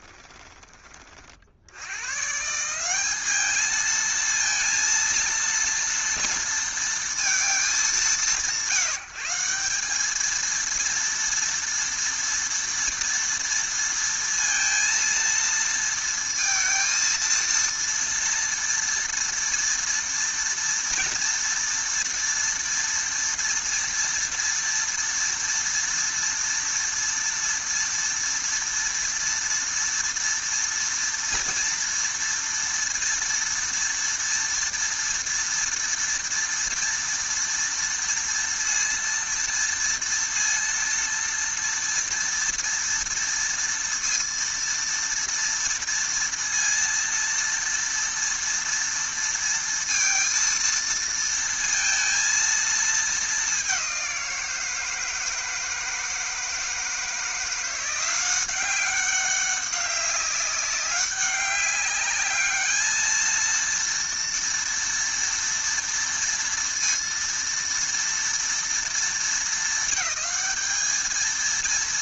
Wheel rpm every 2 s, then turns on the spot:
20, 160, 230, 230, 160, 230, 230, 230, 230, 240, 230, 230, 230, 230, 230, 230, 230, 230, 230, 230, 230, 230, 230, 230, 230, 230, 230, 170, 160, 190, 190, 210, 230, 230, 230, 220.
none